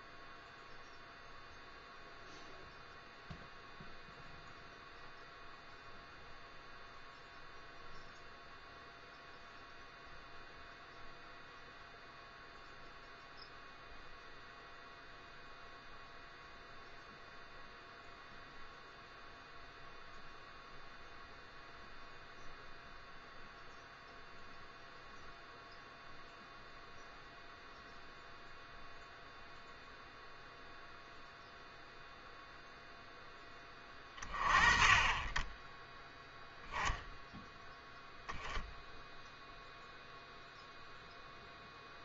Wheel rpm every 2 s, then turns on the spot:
0, 0, 0, 0, 0, 0, 0, 0, 0, 0, 0, 0, 0, 0, 0, 0, 0, 30, 0, 0, 0.
none